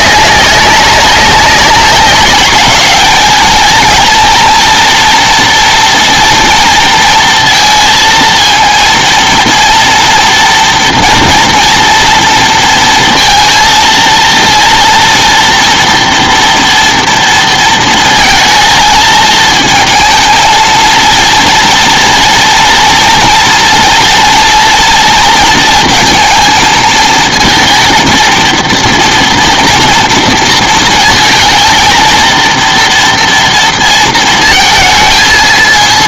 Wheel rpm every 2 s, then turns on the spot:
190, 210, 230, 230, 230, 230, 230, 230, 240, 220, 230, 240, 230, 230, 230, 220, 230, 230.
none